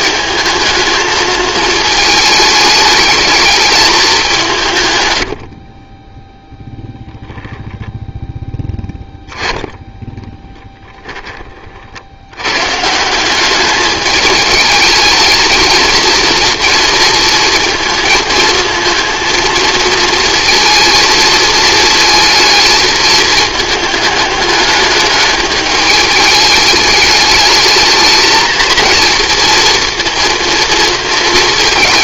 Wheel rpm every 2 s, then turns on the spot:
220, 210, 160, 0, 10, 10, 130, 210, 230, 230, 230, 220, 210, 210, 230, 230.
none